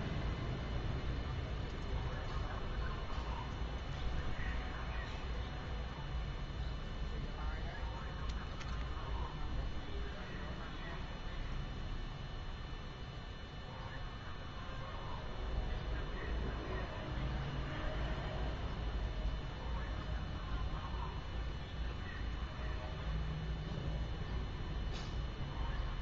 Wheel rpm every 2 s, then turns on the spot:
0, 0, 0, 0, 0, 0, 0, 0, 0, 0, 0, 0, 0.
none